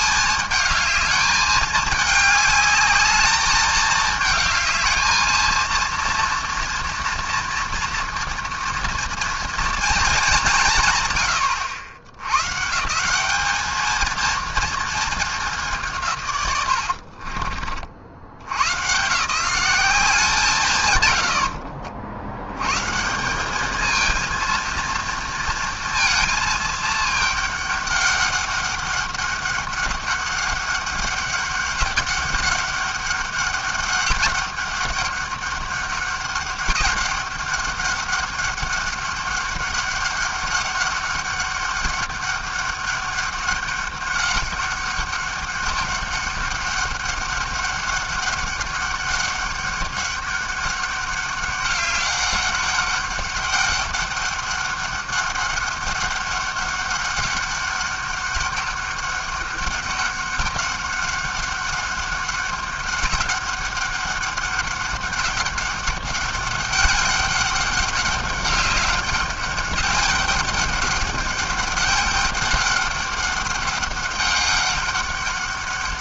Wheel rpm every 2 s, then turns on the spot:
210, 210, 210, 230, 230, 170, 140, 230, 110, 90, 160, 110, 230, 220, 200, 200, 200, 200, 200, 200, 200, 200, 200, 200, 200, 200, 200, 200, 200, 200, 200, 200, 200, 200, 200, 200, 200, 200.
none